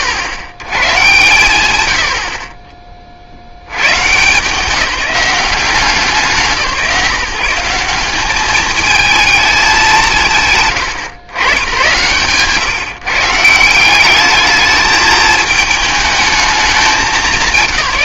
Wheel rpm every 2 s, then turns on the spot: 110, 30, 190, 130, 210, 120, 160, 210, 200.
none